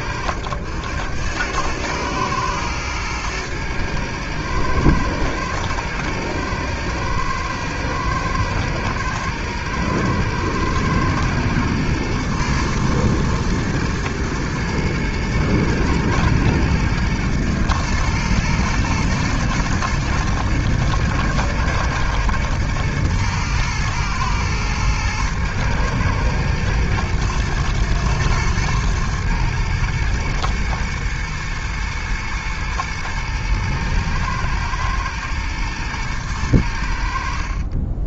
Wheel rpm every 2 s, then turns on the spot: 90, 110, 110, 120, 120, 110, 110, 110, 120, 110, 110, 110, 110, 110, 110, 110, 120, 110, 90.
none